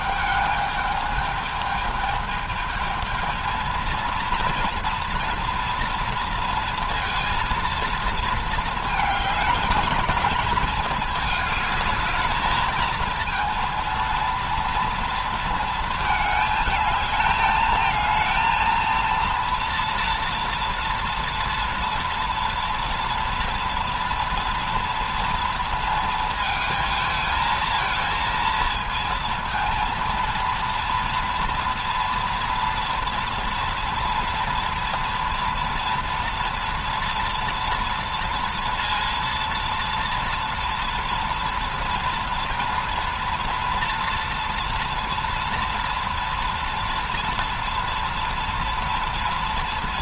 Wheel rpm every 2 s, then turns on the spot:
220, 220, 230, 230, 220, 220, 220, 230, 220, 230, 230, 230, 230, 220, 230, 230, 230, 230, 230, 230, 240, 230, 230, 230, 230.
none